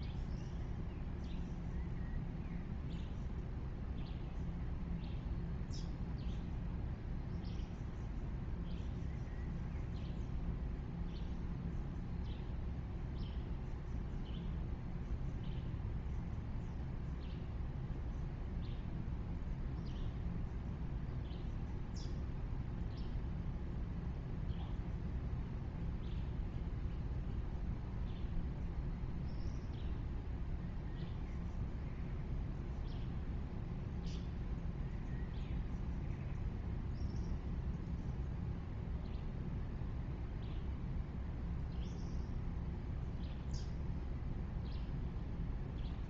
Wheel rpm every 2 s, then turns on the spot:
0, 0, 0, 0, 0, 0, 0, 0, 0, 0, 0, 0, 0, 0, 0, 0, 0, 0, 0, 0, 0, 0, 0.
none